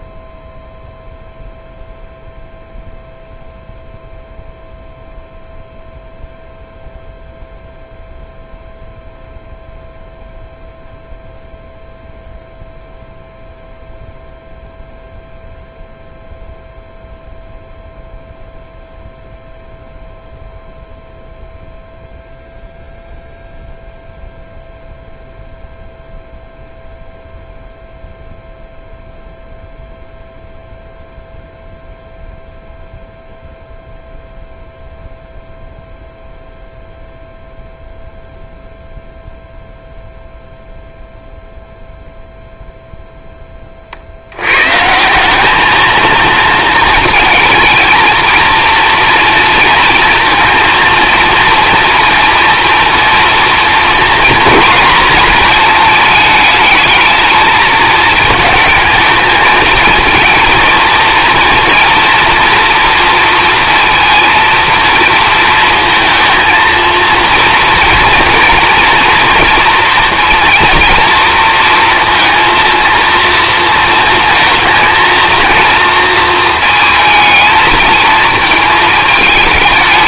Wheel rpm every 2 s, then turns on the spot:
0, 0, 0, 0, 0, 0, 0, 0, 0, 0, 0, 0, 0, 0, 0, 0, 0, 0, 0, 0, 0, 0, 150, 220, 230, 230, 230, 240, 220, 220, 230, 230, 230, 230, 240, 230, 230, 230, 220, 220.
none